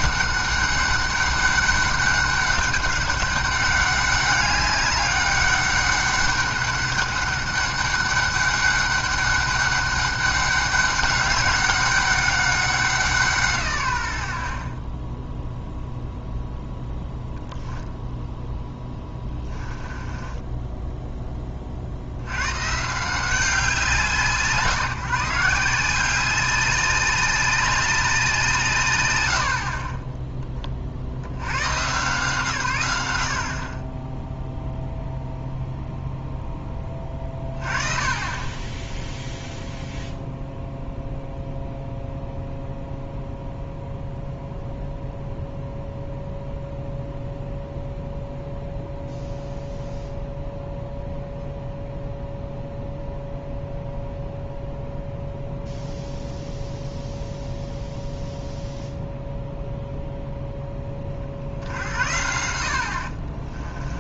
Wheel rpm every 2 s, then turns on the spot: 200, 200, 200, 200, 200, 200, 190, 40, 0, 10, 10, 140, 150, 190, 150, 40, 110, 0, 10, 10, 0, 0, 0, 0, 0, 0, 0, 0, 0, 0, 20, 60.
18-22